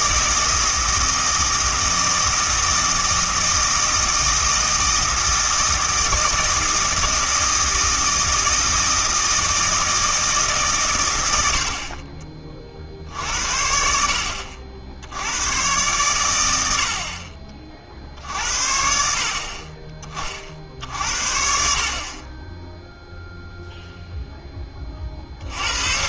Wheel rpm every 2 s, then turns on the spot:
160, 160, 160, 160, 160, 140, 40, 60, 80, 60, 60, 0, 20.
none